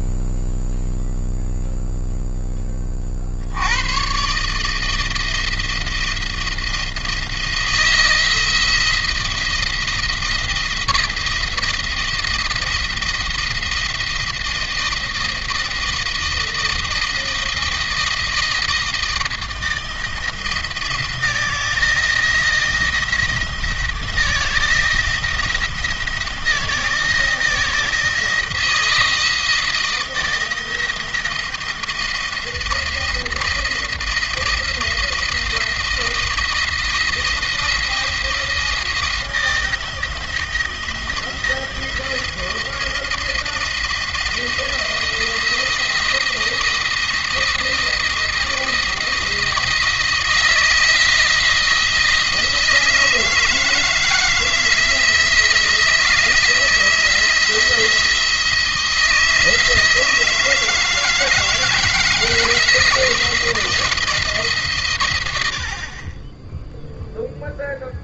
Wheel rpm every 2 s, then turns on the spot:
0, 20, 150, 170, 170, 170, 170, 160, 160, 160, 170, 170, 160, 160, 160, 160, 170, 170, 170, 170, 170, 170, 170, 170, 170, 160, 160, 170, 170, 170, 160, 170, 150, 10.
none